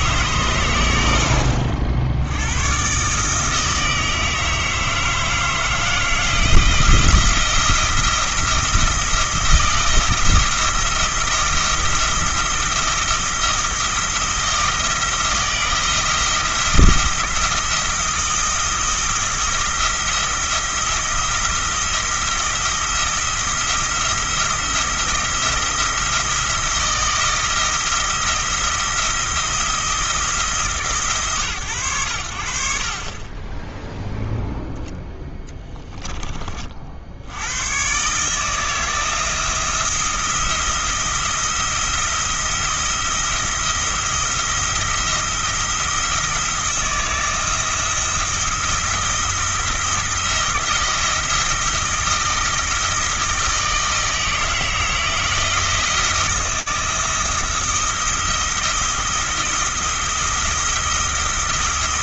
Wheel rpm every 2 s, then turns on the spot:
90, 130, 160, 170, 170, 170, 170, 160, 170, 170, 170, 170, 170, 170, 170, 150, 50, 0, 60, 160, 170, 170, 170, 160, 170, 170, 170, 160, 170, 170, 170.
none